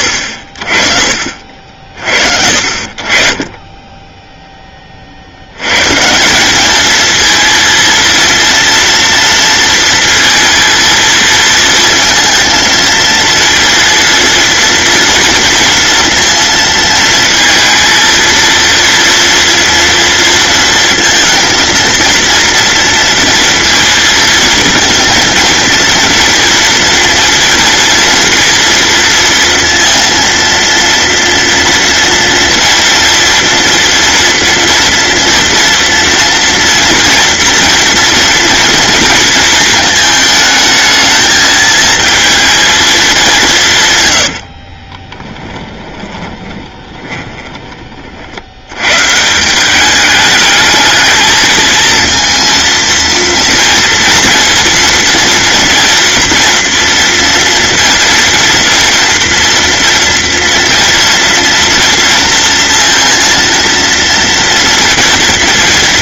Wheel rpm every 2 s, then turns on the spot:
40, 50, 20, 210, 230, 230, 230, 230, 230, 230, 230, 230, 230, 230, 230, 230, 240, 230, 230, 230, 220, 220, 30, 20, 100, 220, 230, 230, 230, 230, 230, 230, 230.
44-48